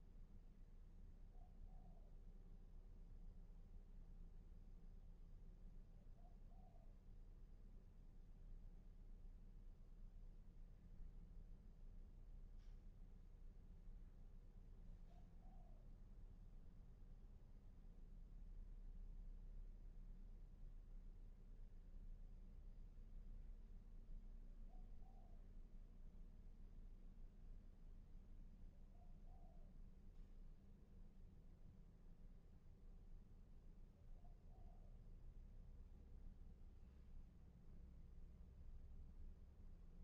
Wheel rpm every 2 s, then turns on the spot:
0, 0, 0, 0, 0, 0, 0, 0, 0, 0, 0, 0, 0, 0, 0, 0, 0, 0, 0, 0.
none